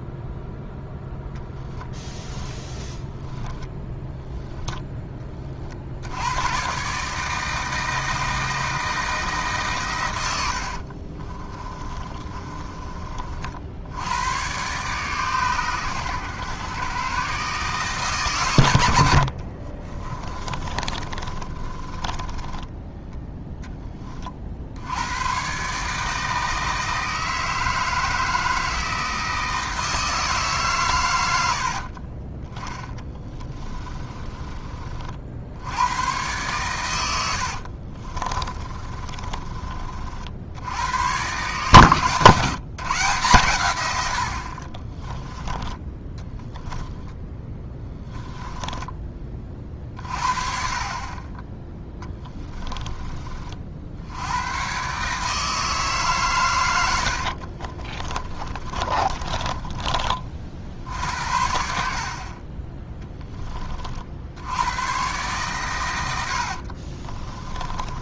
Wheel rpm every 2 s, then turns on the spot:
0, 10, 10, 130, 160, 60, 40, 130, 120, 100, 30, 10, 80, 160, 160, 130, 10, 40, 110, 30, 100, 150, 40, 0, 10, 30, 30, 130, 90, 30, 50, 10, 110, 50.
2-4 10-12 20-22 32-34 38-40 44-46 56-60 66-68